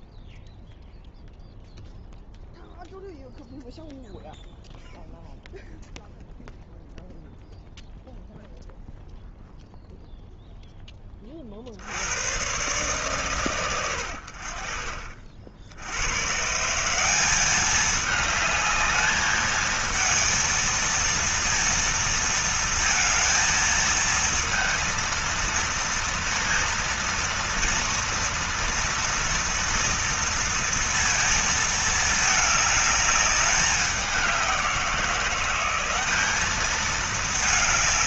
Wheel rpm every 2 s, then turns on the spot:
0, 0, 0, 0, 0, 10, 130, 50, 150, 210, 230, 230, 230, 230, 230, 230, 210, 180, 210.
none